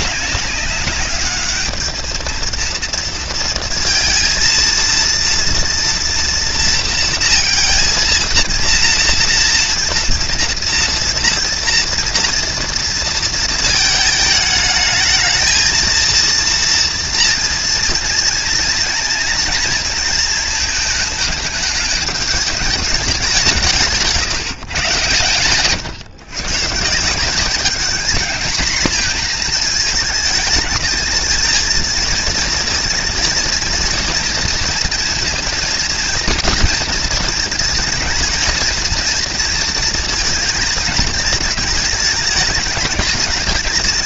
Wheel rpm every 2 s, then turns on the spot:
200, 230, 230, 240, 230, 230, 230, 220, 230, 230, 220, 210, 140, 140, 230, 220, 230, 230, 230, 230, 230, 220.
none